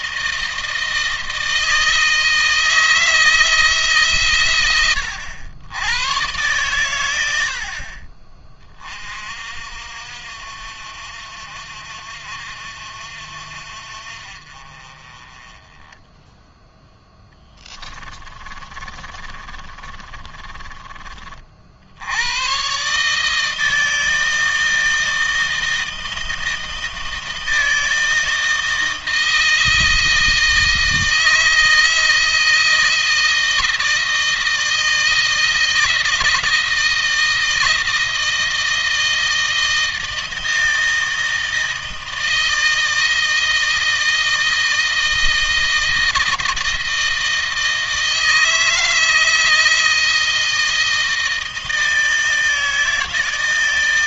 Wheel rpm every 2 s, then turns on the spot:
160, 160, 100, 110, 40, 60, 60, 30, 10, 40, 30, 140, 160, 160, 160, 160, 160, 160, 160, 160, 160, 160, 160, 160, 160, 160, 160.
16-20